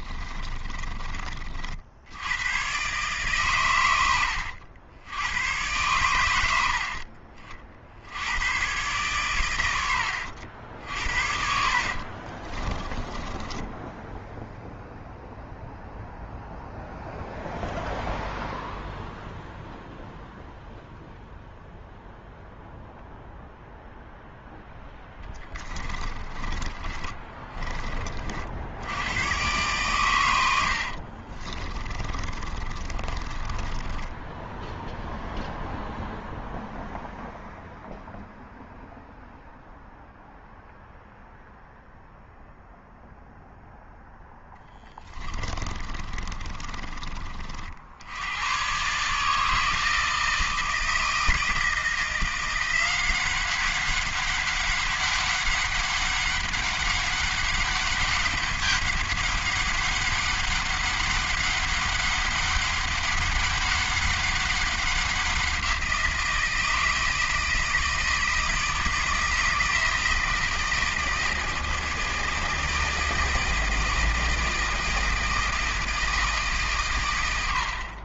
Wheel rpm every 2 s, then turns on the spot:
30, 130, 90, 60, 120, 60, 20, 0, 0, 0, 0, 0, 10, 20, 70, 70, 30, 0, 0, 0, 0, 0, 20, 30, 120, 160, 180, 200, 200, 200, 200, 200, 190, 160, 160, 160, 160, 160, 140.
0-2 10-14 26-28 30-34 44-48